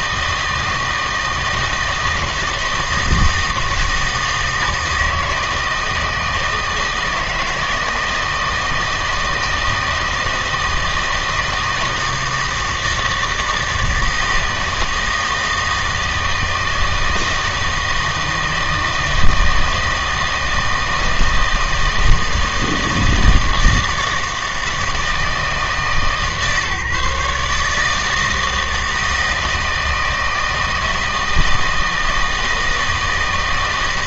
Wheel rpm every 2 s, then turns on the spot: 160, 160, 160, 160, 160, 160, 160, 160, 160, 160, 160, 160, 160, 150, 160, 160, 160.
none